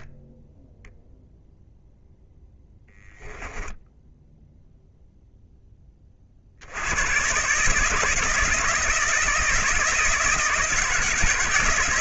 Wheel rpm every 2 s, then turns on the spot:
0, 10, 0, 120, 160, 160.
2-4